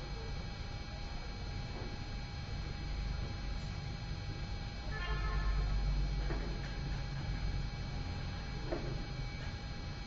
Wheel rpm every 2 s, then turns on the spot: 0, 0, 0, 0, 0.
none